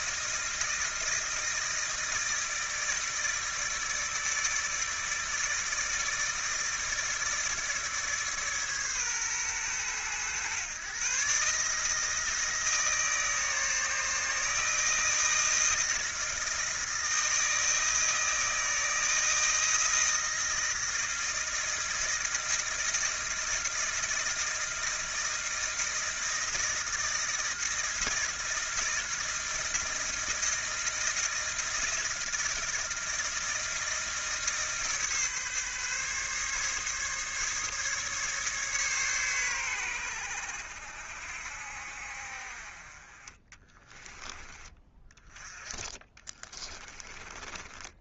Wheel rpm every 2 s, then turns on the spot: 160, 160, 160, 160, 130, 130, 160, 160, 160, 160, 160, 160, 160, 160, 160, 160, 160, 150, 140, 130, 70, 30, 30, 20.
46-48